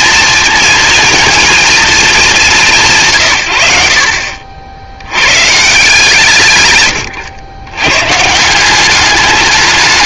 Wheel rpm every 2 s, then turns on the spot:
230, 180, 50, 130, 180.
none